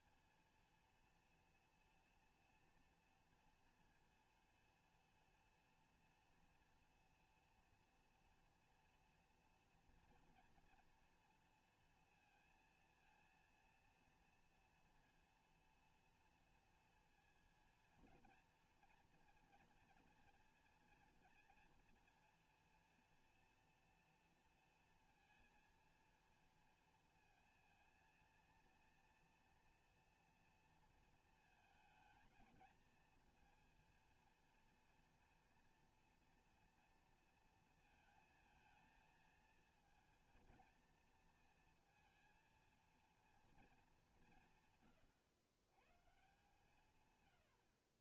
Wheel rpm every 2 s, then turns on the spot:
230, 240, 230, 230, 230, 230, 230, 230, 230, 230, 230, 230, 230, 230, 230, 230, 220, 230, 230, 230, 230, 220, 170, 140.
none